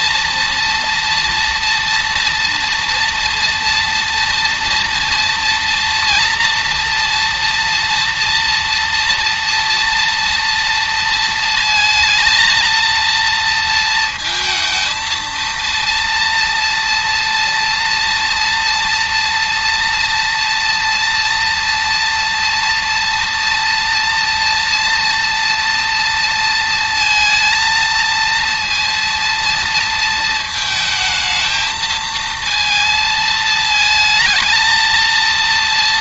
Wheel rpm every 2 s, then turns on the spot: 230, 230, 230, 230, 230, 230, 230, 230, 230, 230, 230, 230, 230, 230, 230, 220, 230, 230.
none